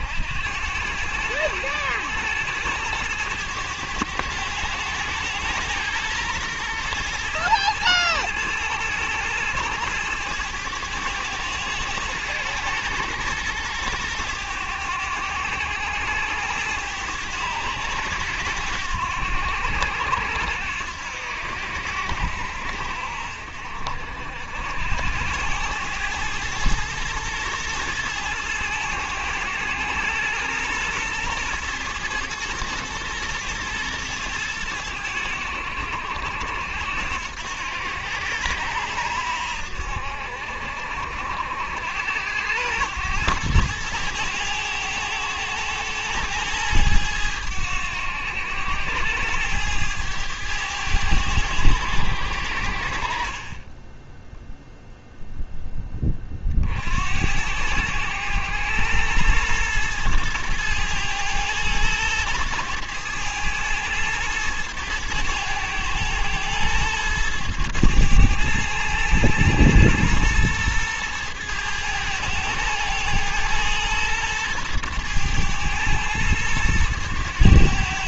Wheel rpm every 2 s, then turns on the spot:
90, 100, 100, 110, 110, 110, 110, 100, 100, 90, 80, 70, 70, 110, 110, 110, 110, 100, 80, 90, 60, 100, 110, 110, 100, 100, 60, 0, 50, 110, 110, 110, 110, 110, 110, 110, 110, 110, 110.
none